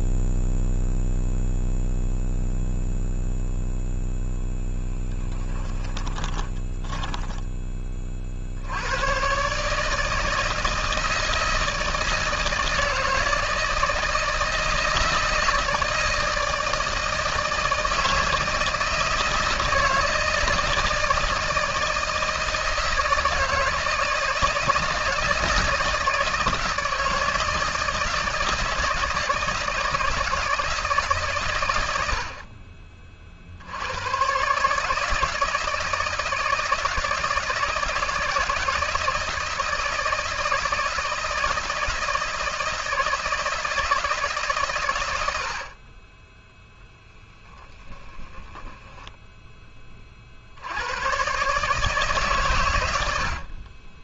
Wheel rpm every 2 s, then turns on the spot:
0, 0, 0, 20, 80, 160, 160, 160, 160, 160, 160, 160, 160, 160, 160, 160, 40, 140, 160, 160, 160, 160, 130, 0, 20, 80, 110.
6-8 48-50